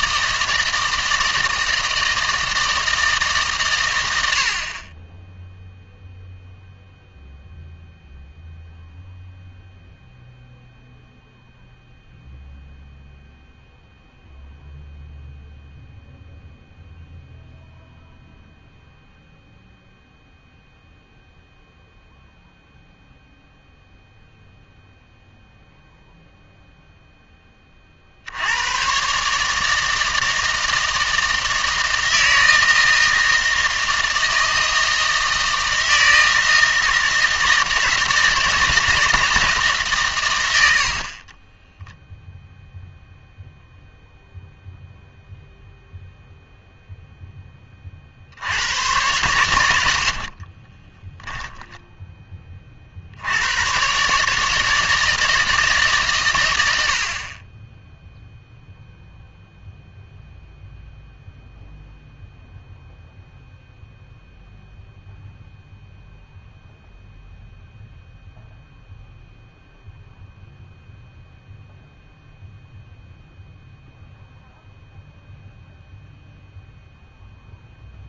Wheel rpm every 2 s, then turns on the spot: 160, 160, 60, 0, 0, 0, 0, 0, 0, 0, 0, 0, 0, 0, 100, 160, 160, 160, 160, 160, 100, 0, 0, 0, 90, 30, 30, 160, 100, 0, 0, 0, 0, 0, 0, 0, 0, 0, 0.
50-52